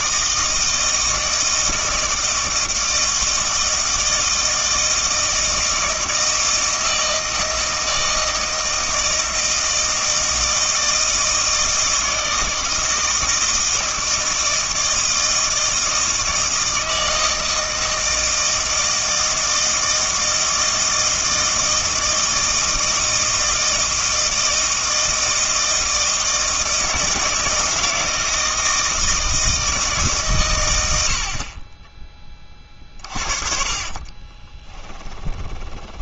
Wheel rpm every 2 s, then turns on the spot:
160, 160, 160, 160, 160, 160, 160, 160, 160, 160, 160, 160, 160, 160, 160, 100, 40, 20.
32-36